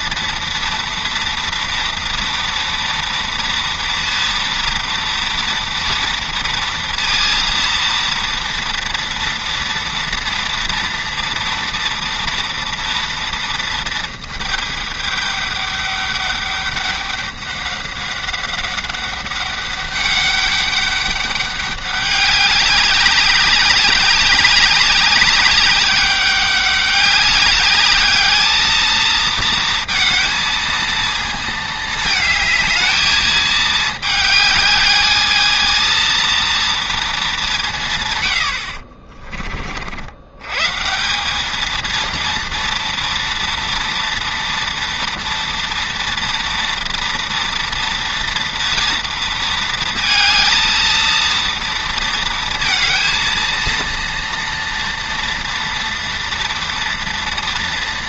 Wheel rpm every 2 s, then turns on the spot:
230, 230, 230, 230, 230, 230, 230, 220, 200, 190, 200, 200, 200, 200, 220, 220, 220, 210, 230, 70, 140, 230, 230, 230, 230, 230, 230, 230, 230.
none